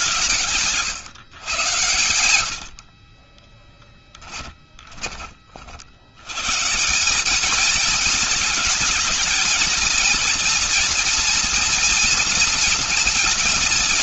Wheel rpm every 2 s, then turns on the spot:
150, 50, 20, 190, 230, 230, 230.
2-4